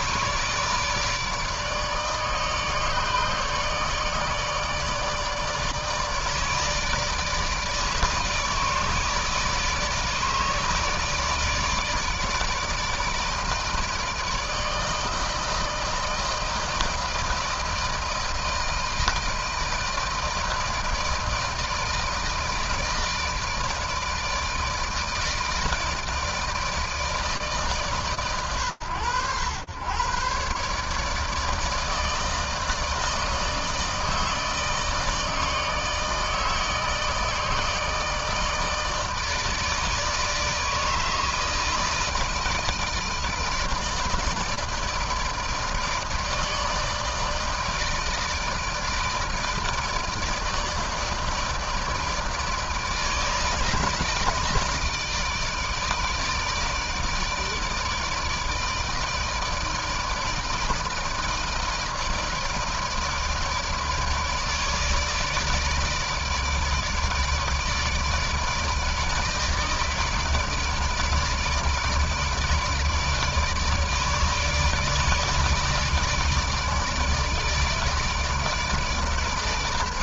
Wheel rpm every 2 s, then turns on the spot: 150, 150, 150, 150, 160, 150, 160, 160, 160, 160, 160, 160, 160, 150, 110, 160, 160, 160, 160, 160, 160, 160, 160, 160, 160, 160, 160, 160, 160, 160, 160, 160, 160, 160, 160, 160, 160, 150, 150, 150.
none